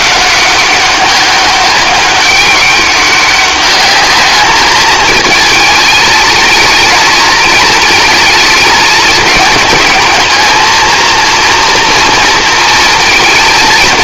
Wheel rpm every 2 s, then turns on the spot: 190, 200, 210, 220, 210, 220, 230.
none